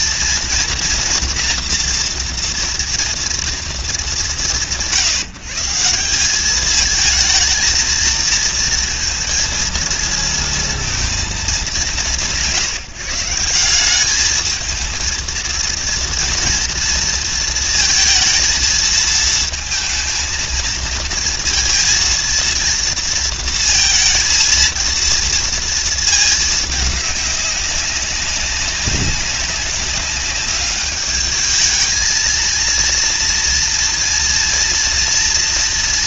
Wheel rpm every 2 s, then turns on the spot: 230, 230, 150, 210, 230, 230, 160, 220, 230, 230, 230, 230, 230, 220, 190, 200, 230, 230.
none